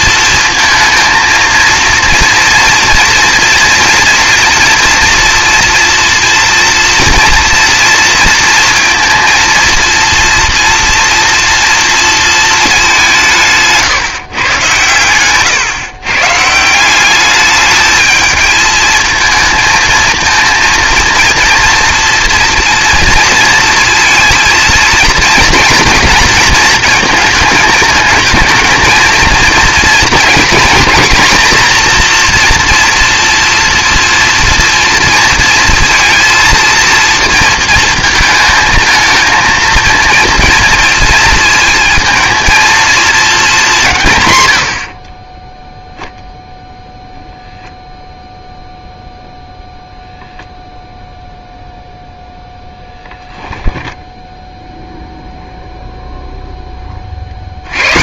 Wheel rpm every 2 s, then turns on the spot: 230, 230, 230, 230, 230, 230, 220, 130, 160, 220, 220, 240, 230, 230, 220, 240, 240, 230, 230, 220, 230, 220, 90, 0, 0, 0, 10, 0, 0.
52-54